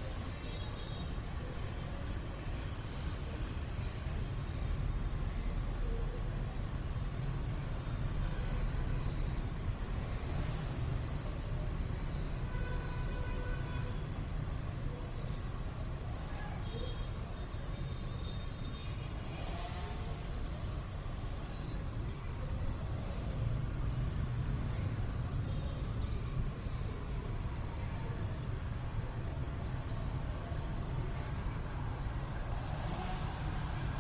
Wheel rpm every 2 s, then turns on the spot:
0, 0, 0, 0, 0, 0, 0, 0, 0, 0, 0, 0, 0, 0, 0, 0, 0.
none